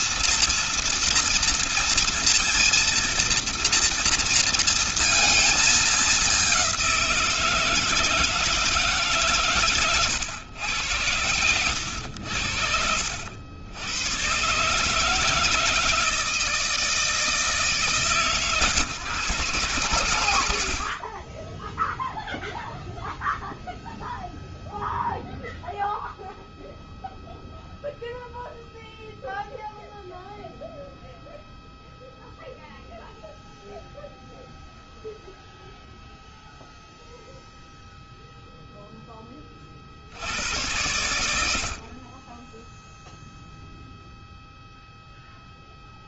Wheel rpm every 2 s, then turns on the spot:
230, 230, 230, 180, 160, 100, 80, 150, 160, 140, 60, 0, 0, 0, 0, 0, 0, 0, 0, 0, 100, 0, 0.
none